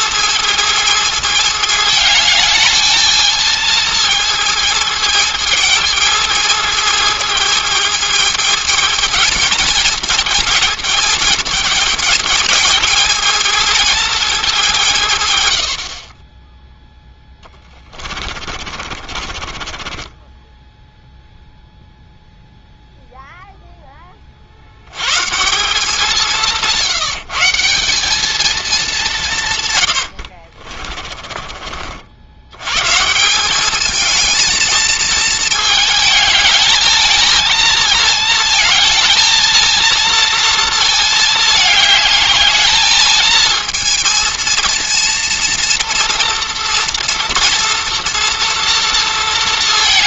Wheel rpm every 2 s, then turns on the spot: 220, 220, 220, 220, 220, 220, 220, 180, 0, 40, 0, 0, 110, 170, 210, 40, 130, 220, 210, 220, 220, 220, 230, 230, 230.
18-20 30-32